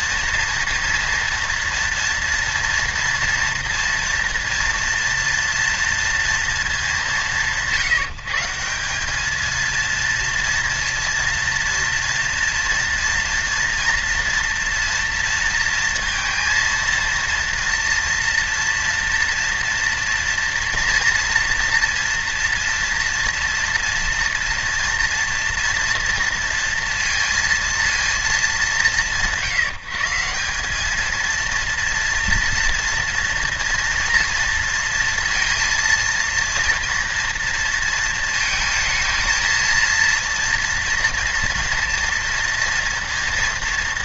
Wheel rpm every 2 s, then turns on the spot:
230, 230, 230, 220, 170, 230, 230, 230, 230, 230, 240, 230, 230, 230, 180, 200, 230, 230, 230, 230, 230, 230.
none